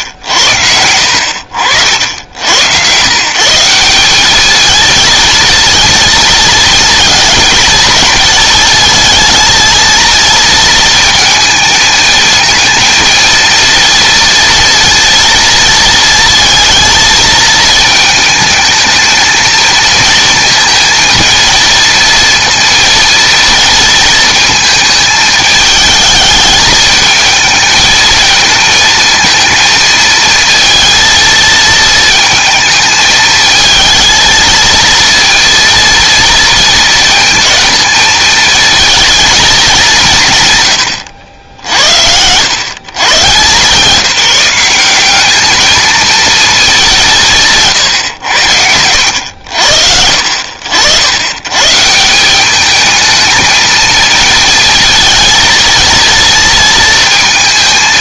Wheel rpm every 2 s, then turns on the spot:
70, 120, 220, 220, 220, 230, 230, 230, 230, 220, 230, 230, 220, 220, 220, 230, 220, 230, 220, 220, 110, 130, 190, 190, 90, 80, 210, 230, 230.
none